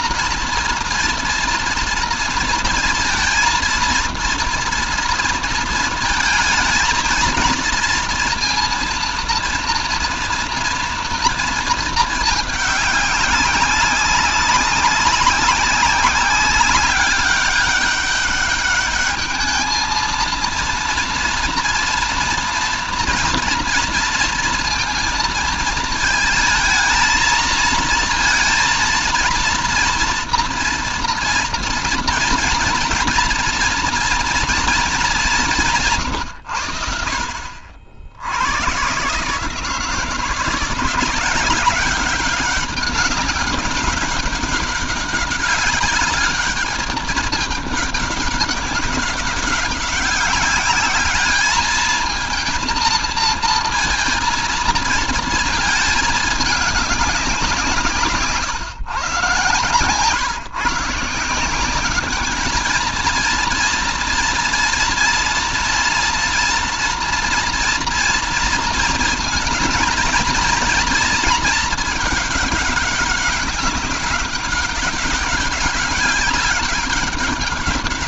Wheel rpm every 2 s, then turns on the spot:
230, 230, 230, 220, 230, 230, 200, 200, 200, 210, 230, 230, 230, 220, 230, 230, 230, 220, 70, 130, 170, 190, 190, 210, 190, 210, 230, 230, 210, 140, 170, 230, 230, 230, 230, 230, 200, 190, 200.
none